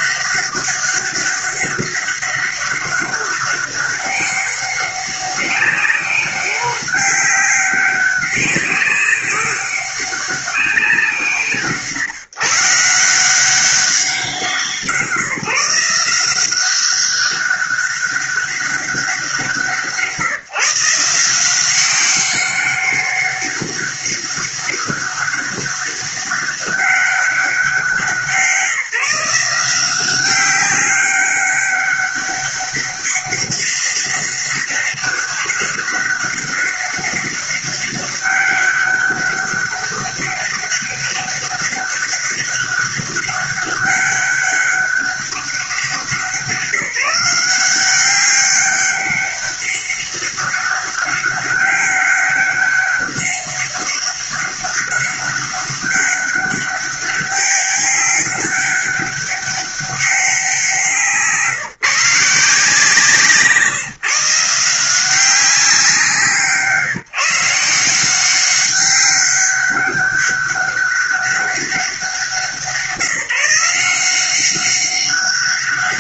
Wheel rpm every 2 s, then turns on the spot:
200, 200, 200, 190, 200, 200, 150, 180, 180, 200, 160, 190, 200, 200, 170, 190, 200, 200, 200, 200, 200, 200, 200, 170, 190, 200, 200, 200, 200, 200, 190, 160, 160, 160, 190, 200, 180, 190.
none